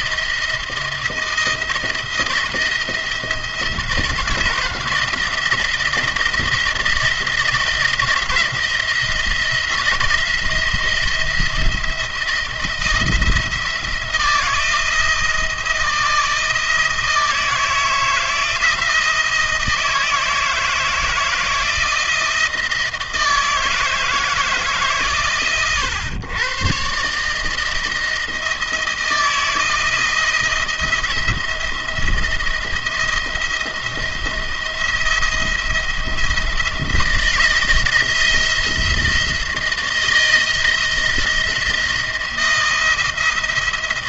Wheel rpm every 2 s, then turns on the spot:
160, 170, 170, 160, 170, 170, 170, 170, 160, 160, 160, 160, 140, 130, 160, 160, 170, 170, 160, 170, 170, 170.
none